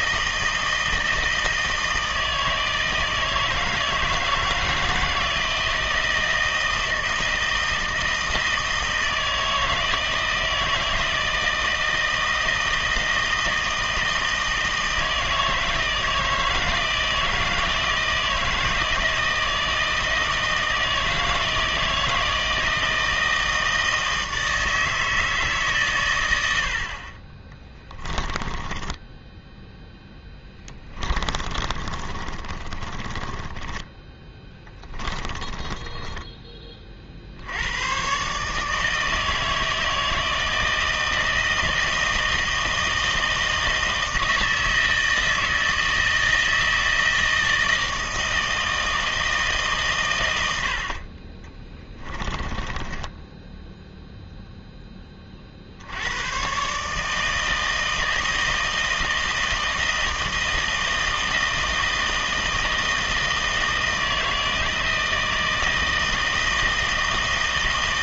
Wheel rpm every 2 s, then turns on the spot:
160, 160, 160, 160, 160, 160, 160, 160, 160, 160, 160, 160, 160, 70, 20, 10, 30, 10, 20, 150, 160, 160, 160, 160, 160, 70, 20, 0, 130, 160, 160, 160, 160, 160.
28-36 50-54